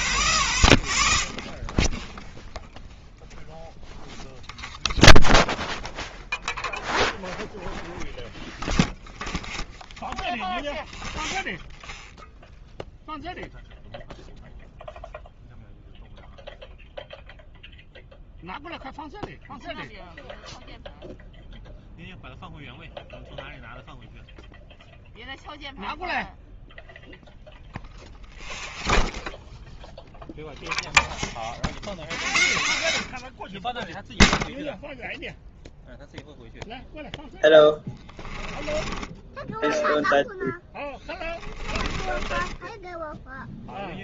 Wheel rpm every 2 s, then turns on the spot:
0, 0, 0, 0, 0, 0, 0, 0, 0, 0, 0, 0, 0, 0, 0, 0, 70, 0, 0, 20, 10, 10.
38-44